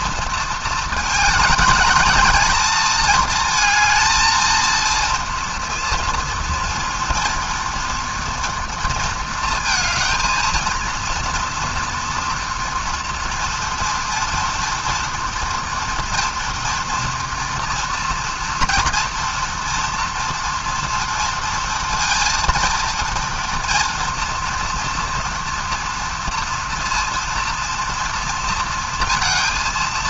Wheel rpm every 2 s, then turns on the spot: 230, 210, 220, 230, 230, 220, 240, 230, 230, 240, 230, 230, 230, 230, 230.
none